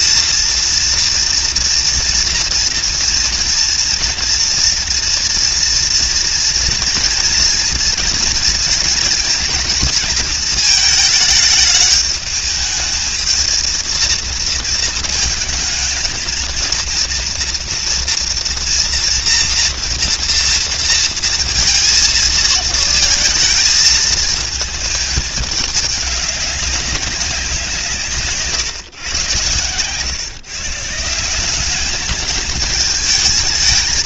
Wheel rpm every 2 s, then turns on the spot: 240, 240, 230, 230, 230, 220, 210, 230, 230, 240, 230, 220, 220, 200, 140, 160, 220.
none